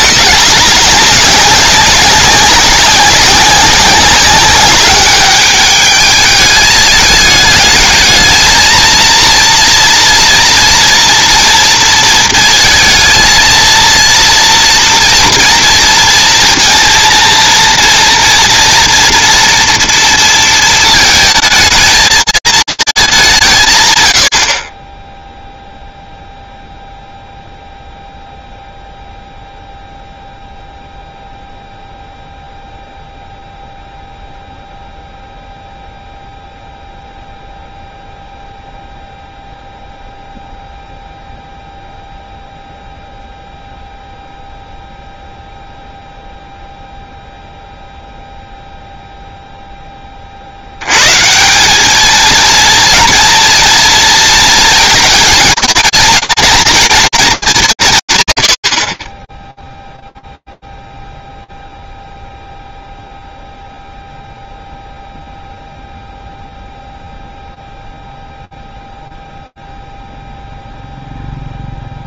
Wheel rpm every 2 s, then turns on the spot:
200, 190, 200, 210, 220, 230, 230, 230, 230, 240, 230, 220, 50, 0, 0, 0, 0, 0, 0, 0, 0, 0, 0, 0, 0, 100, 230, 230, 220, 60, 0, 0, 0, 0, 0, 0.
none